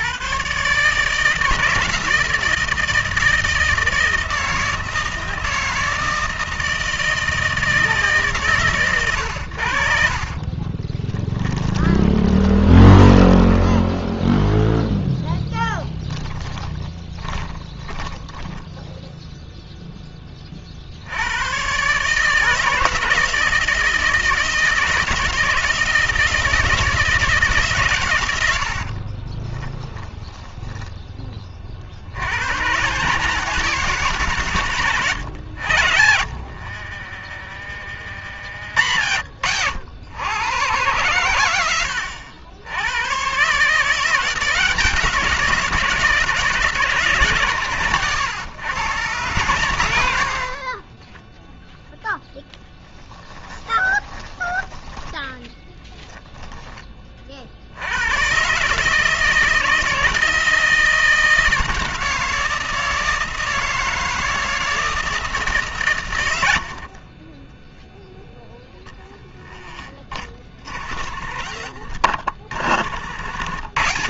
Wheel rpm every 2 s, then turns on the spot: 160, 160, 160, 160, 70, 20, 10, 10, 20, 0, 110, 160, 160, 150, 30, 30, 170, 90, 30, 90, 110, 140, 170, 150, 140, 10, 10, 10, 30, 160, 170, 160, 160, 10, 20, 50, 60.
10-18 28-30 34-38 50-56 66-68